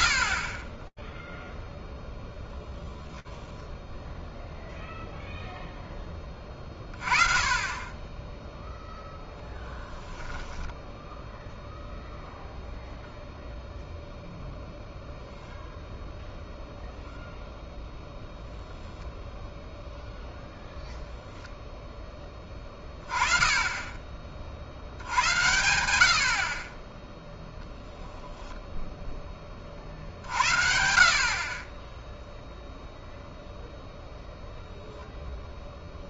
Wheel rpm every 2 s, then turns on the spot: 0, 30, 0, 10, 0, 0, 0, 0, 0, 10, 30, 80, 0, 10, 50, 0, 0, 140.
none